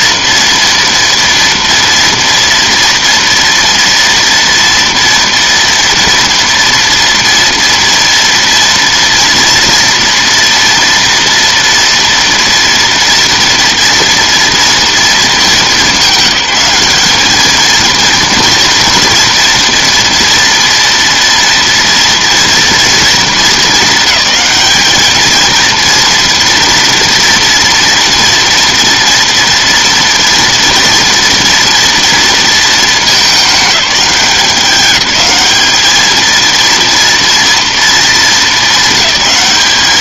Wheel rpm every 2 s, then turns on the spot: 240, 230, 230, 230, 230, 230, 230, 230, 200, 230, 230, 230, 220, 230, 230, 230, 220, 190, 230, 220.
none